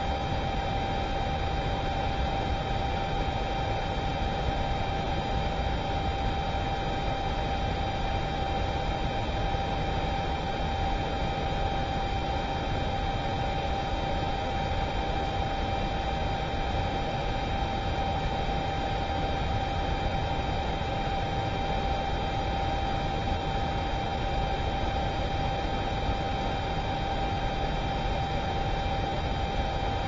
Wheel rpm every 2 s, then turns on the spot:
0, 0, 0, 0, 0, 0, 0, 0, 0, 0, 0, 0, 0, 0, 0.
none